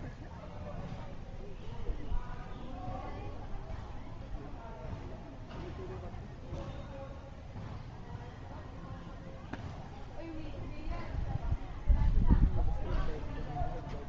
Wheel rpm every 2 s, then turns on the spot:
0, 0, 0, 0, 0, 0, 0.
none